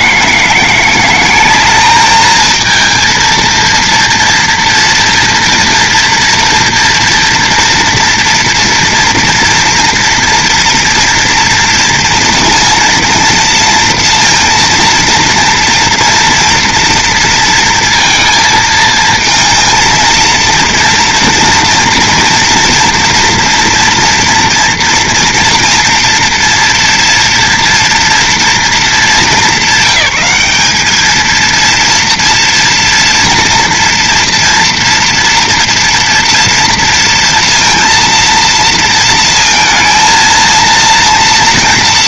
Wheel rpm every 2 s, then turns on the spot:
170, 220, 230, 230, 230, 230, 230, 230, 230, 220, 230, 230, 230, 230, 220, 200, 240, 230, 230, 230, 230.
none